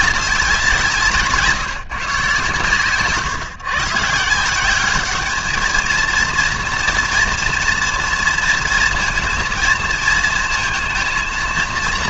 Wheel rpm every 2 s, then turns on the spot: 170, 130, 180, 230, 230, 230.
none